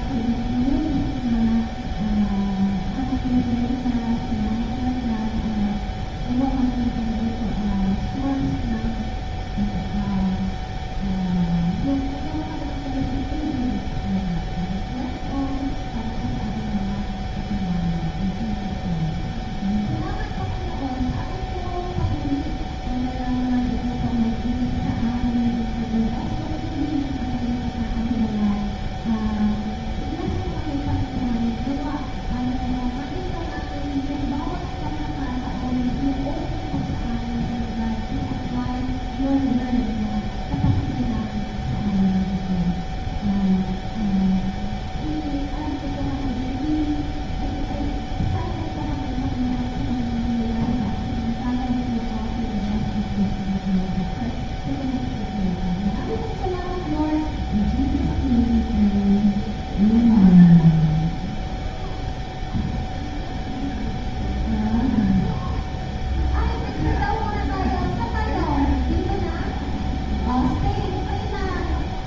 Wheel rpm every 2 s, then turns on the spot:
0, 0, 0, 0, 0, 0, 0, 0, 0, 0, 0, 0, 0, 0, 0, 0, 0, 0, 0, 0, 0, 0, 0, 0, 0, 0, 0, 0, 0, 0, 0, 0, 0, 0, 0, 0.
none